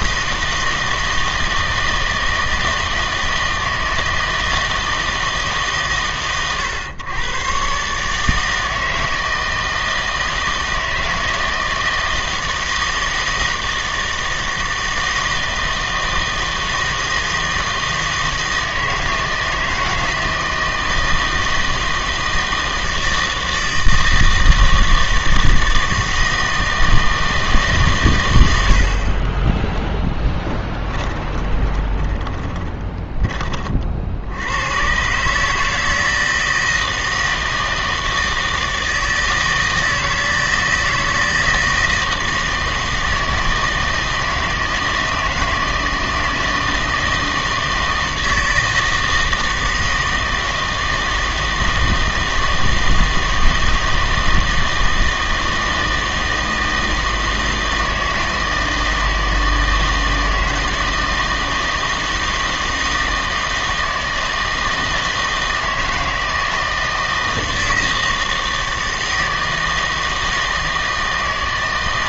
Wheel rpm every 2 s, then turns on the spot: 160, 160, 160, 120, 160, 160, 160, 160, 160, 160, 160, 160, 160, 160, 80, 20, 10, 100, 160, 160, 160, 160, 160, 160, 160, 160, 160, 160, 160, 160, 160, 160, 160, 160, 160, 160.
30-34